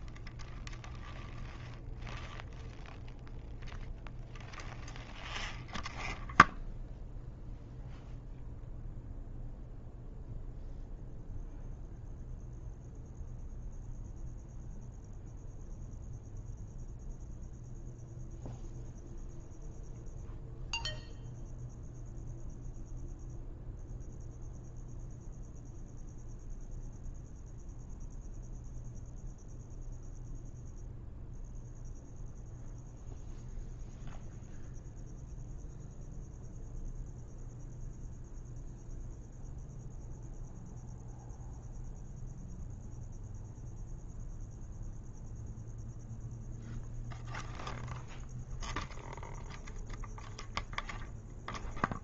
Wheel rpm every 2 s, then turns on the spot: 0, 0, 0, 0, 0, 0, 0, 0, 0, 0, 0, 0, 0, 0, 0, 0, 0, 0, 0, 0, 0, 0, 0, 0, 0, 0.
none